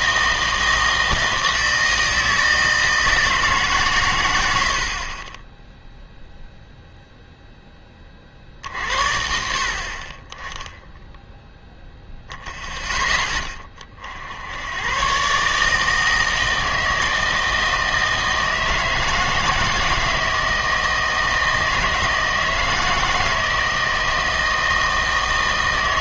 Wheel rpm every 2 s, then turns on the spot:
160, 160, 70, 0, 60, 10, 0, 100, 160, 160, 160, 160, 160.
none